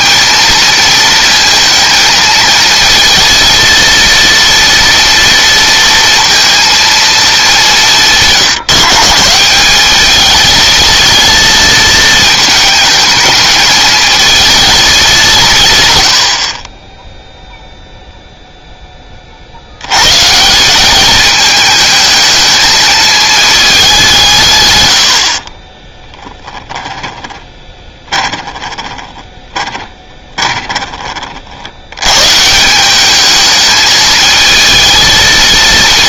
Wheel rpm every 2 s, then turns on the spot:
230, 230, 230, 230, 150, 220, 220, 200, 10, 10, 190, 220, 90, 20, 20, 30, 190, 230.
26-30